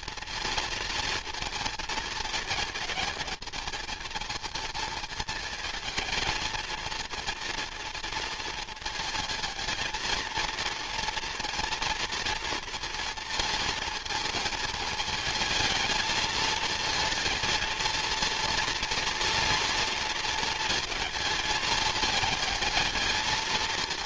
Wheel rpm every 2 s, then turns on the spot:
230, 220, 220, 230, 230, 230, 230, 220, 230, 230, 220, 210.
none